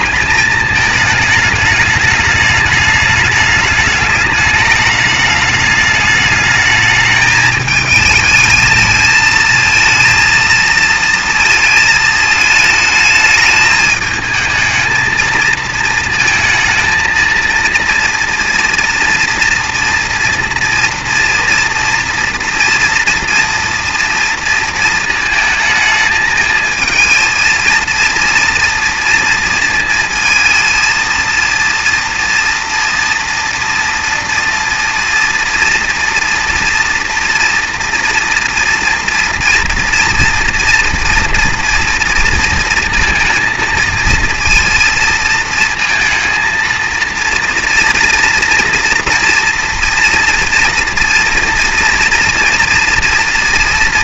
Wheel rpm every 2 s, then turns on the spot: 210, 210, 210, 210, 220, 230, 220, 220, 220, 230, 230, 230, 230, 220, 230, 230, 230, 240, 240, 240, 230, 230, 230, 230, 230, 230, 230.
none